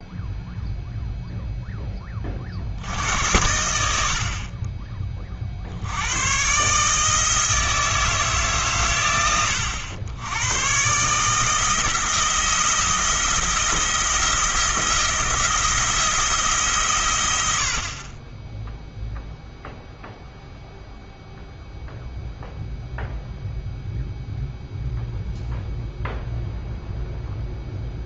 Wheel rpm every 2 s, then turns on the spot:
0, 50, 30, 120, 140, 110, 170, 170, 160, 10, 0, 0, 0, 0.
none